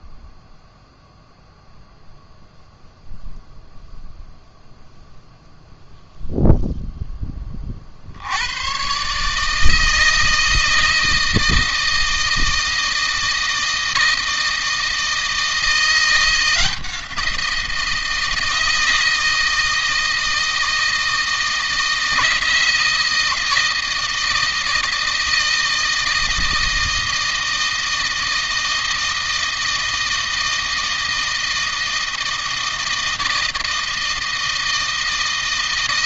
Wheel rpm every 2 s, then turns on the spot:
0, 0, 0, 0, 100, 160, 160, 160, 170, 160, 160, 160, 160, 160, 160, 160, 160, 160.
none